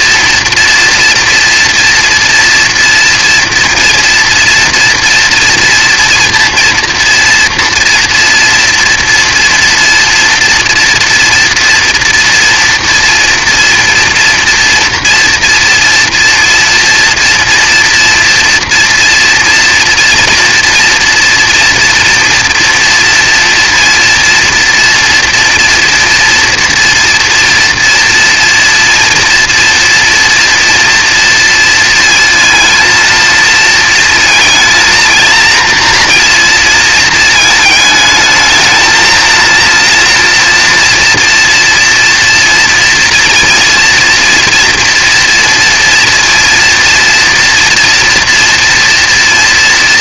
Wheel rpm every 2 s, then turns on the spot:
230, 240, 240, 230, 240, 230, 230, 230, 230, 240, 240, 230, 230, 230, 240, 230, 230, 230, 230, 220, 240, 230, 230, 230, 230.
none